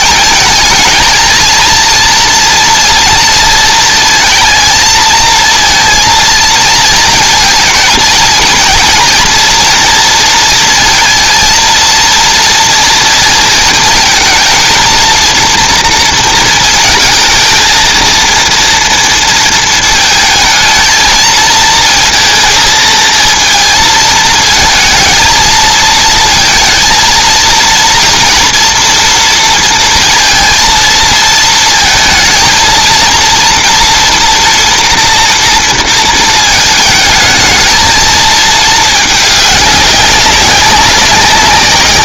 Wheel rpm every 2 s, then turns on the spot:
220, 230, 220, 220, 230, 230, 230, 230, 230, 230, 220, 220, 220, 230, 240, 230, 230, 230, 220, 220, 190.
none